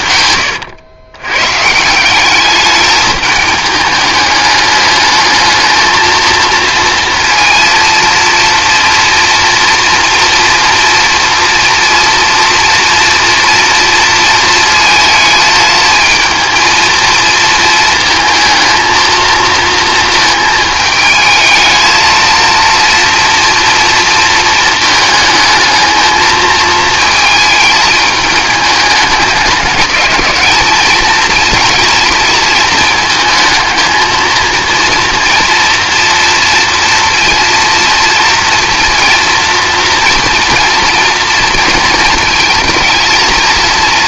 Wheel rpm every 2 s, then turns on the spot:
110, 210, 210, 230, 230, 240, 240, 220, 220, 220, 220, 230, 220, 220, 210, 220, 220, 230, 230, 230, 230, 220.
none